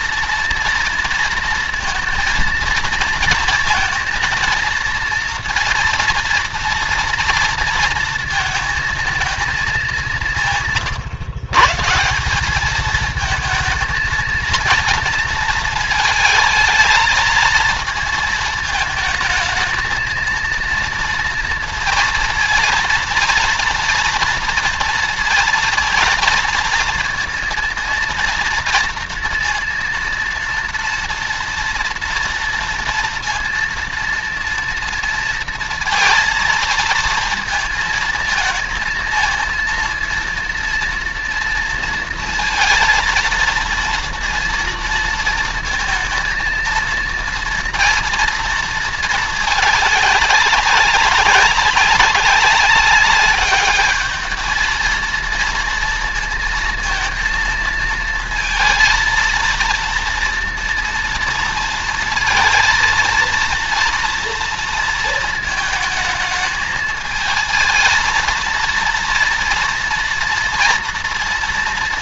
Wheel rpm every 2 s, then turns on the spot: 230, 230, 230, 230, 220, 140, 220, 230, 220, 220, 230, 230, 230, 230, 230, 230, 230, 230, 230, 230, 230, 230, 230, 230, 220, 190, 200, 230, 230, 230, 230, 230, 220, 220, 230, 230.
none